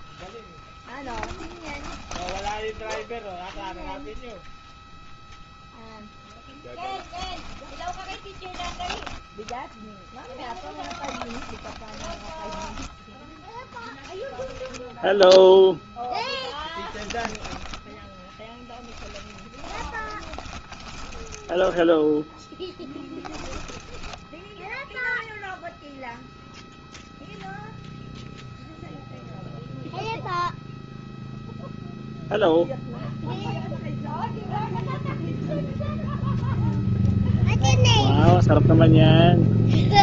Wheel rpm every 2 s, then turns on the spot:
0, 20, 0, 0, 30, 10, 10, 0, 10, 10, 20, 10, 10, 0, 0, 0, 0, 0, 0, 0.
2-4 8-10 12-14 18-26